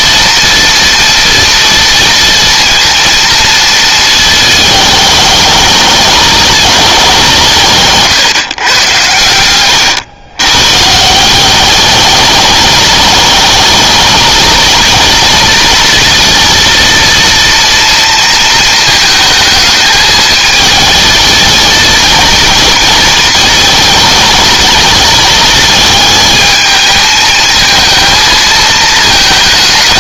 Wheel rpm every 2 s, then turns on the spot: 230, 230, 210, 200, 120, 150, 210, 230, 230, 230, 220, 230, 220, 220, 220.
none